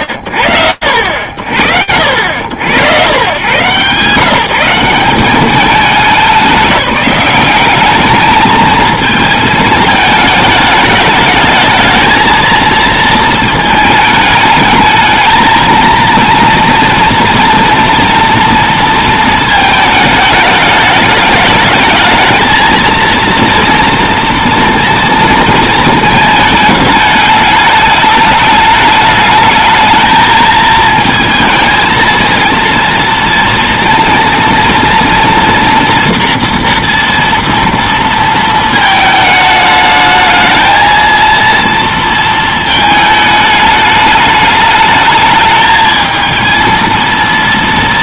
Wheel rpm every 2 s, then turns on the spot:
70, 150, 190, 200, 220, 220, 220, 230, 240, 220, 210, 230, 230, 210, 220, 230, 230, 240, 230, 210, 230, 210, 220, 230.
none